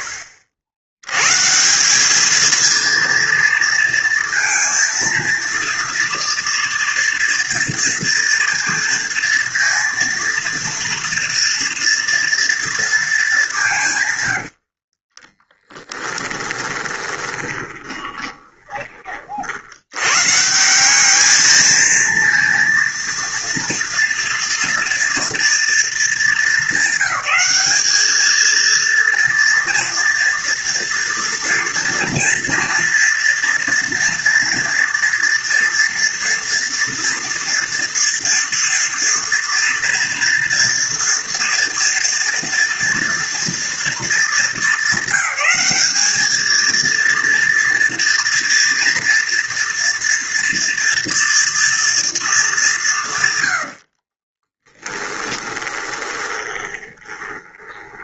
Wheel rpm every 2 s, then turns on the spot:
80, 230, 230, 230, 230, 230, 210, 30, 20, 40, 200, 230, 230, 220, 230, 230, 230, 240, 230, 230, 240, 230, 210, 230, 230, 230, 140, 10, 20.
14-18 54-56